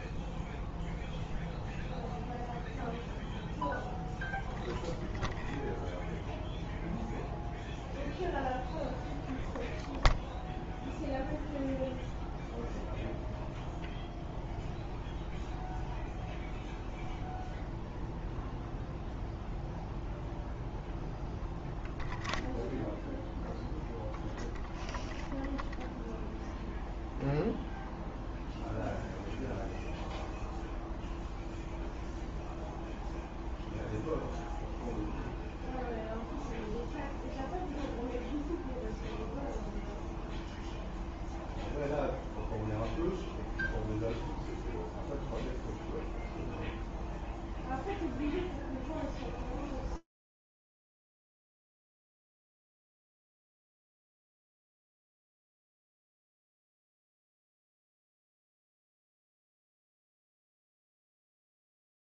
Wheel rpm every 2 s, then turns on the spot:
0, 0, 0, 0, 0, 0, 0, 0, 0, 0, 0, 0, 0, 0, 0, 0, 0, 0, 0, 0, 0, 0, 0, 0, 0, 0, 0, 150, 190, 120, 50.
60-62